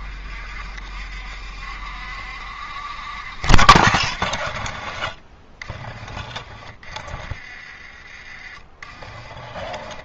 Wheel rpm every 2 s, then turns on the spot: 50, 70, 60, 40, 30.
8-10